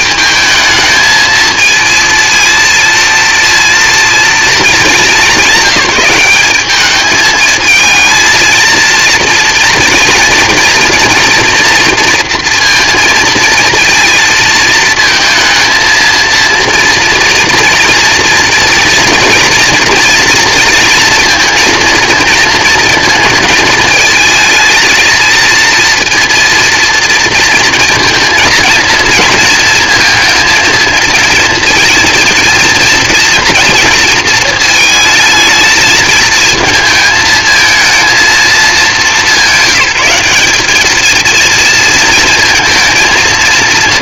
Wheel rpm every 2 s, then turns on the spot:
220, 230, 220, 200, 230, 240, 230, 220, 230, 230, 230, 220, 220, 230, 230, 220, 230, 220, 220, 220, 210, 230.
none